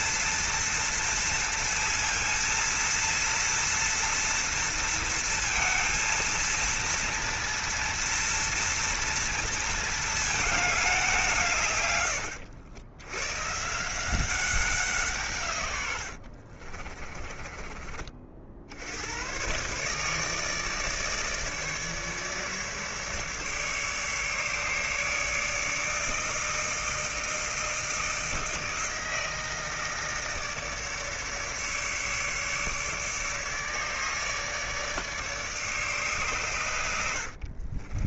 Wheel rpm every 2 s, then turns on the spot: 230, 230, 230, 230, 230, 210, 80, 180, 50, 70, 150, 150, 150, 160, 160, 150, 150, 150, 100.
16-18